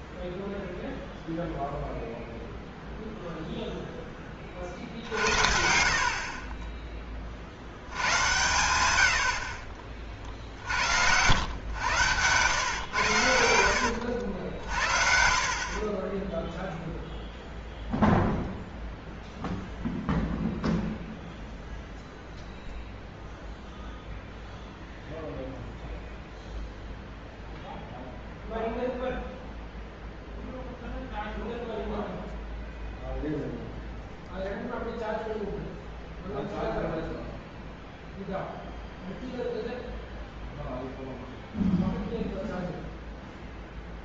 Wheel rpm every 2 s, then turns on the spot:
0, 0, 40, 20, 100, 70, 110, 60, 0, 0, 0, 0, 0, 0, 0, 0, 0, 0, 0, 0, 0, 0.
none